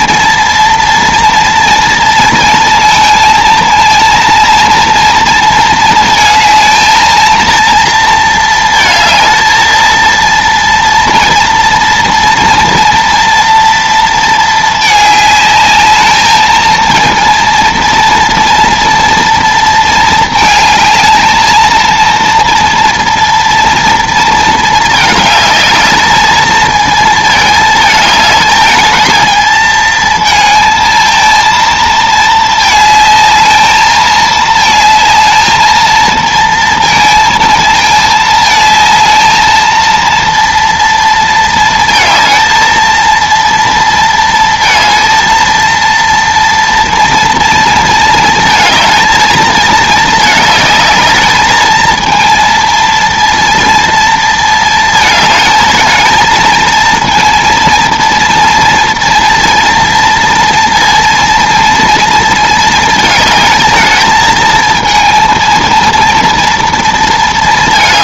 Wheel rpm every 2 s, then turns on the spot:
230, 230, 230, 220, 220, 230, 230, 220, 220, 230, 220, 230, 230, 220, 220, 220, 220, 220, 230, 220, 230, 220, 230, 230, 220, 210, 230, 230, 220, 230, 230, 220, 220, 230.
none